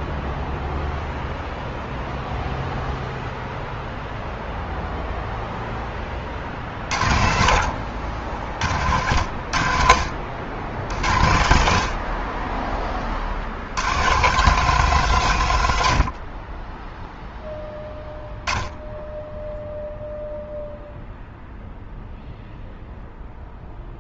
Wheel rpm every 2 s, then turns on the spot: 0, 0, 0, 10, 60, 60, 40, 80, 70, 0, 0, 0.
none